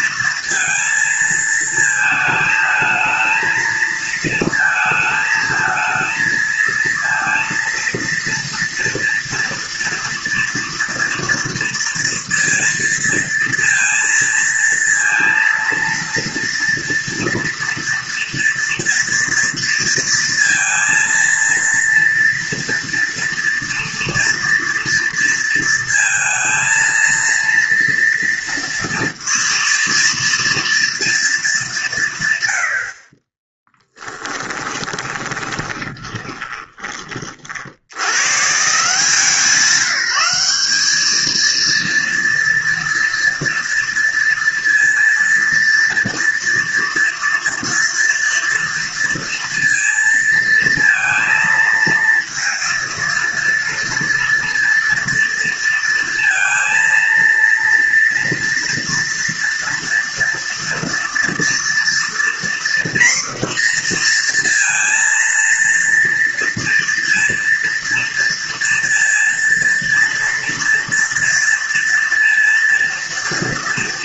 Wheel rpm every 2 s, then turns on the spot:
230, 220, 220, 230, 240, 230, 230, 230, 230, 230, 230, 230, 230, 230, 230, 230, 50, 10, 20, 180, 220, 230, 230, 230, 230, 230, 230, 230, 230, 230, 240, 240, 230, 230, 230, 230, 230.
34-38